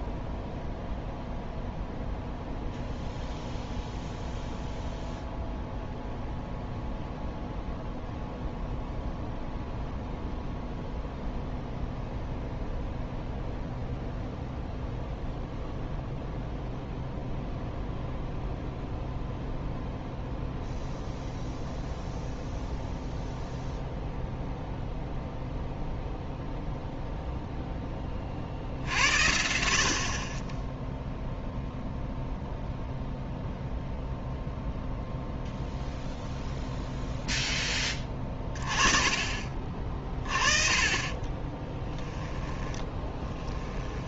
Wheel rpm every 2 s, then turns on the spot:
0, 0, 0, 0, 0, 0, 0, 0, 0, 0, 0, 0, 0, 0, 60, 30, 0, 0, 0, 30, 30, 10.
42-44